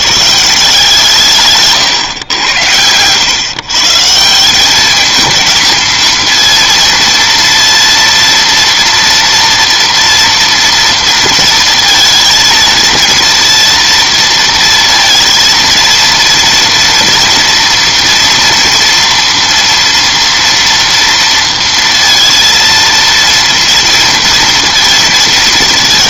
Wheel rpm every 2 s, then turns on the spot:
160, 100, 190, 230, 230, 230, 230, 230, 230, 230, 230, 230, 230.
none